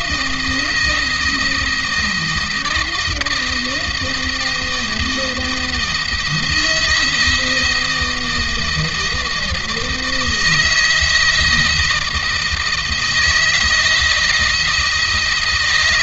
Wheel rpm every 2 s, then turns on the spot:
170, 160, 170, 160, 160, 160, 160, 160.
none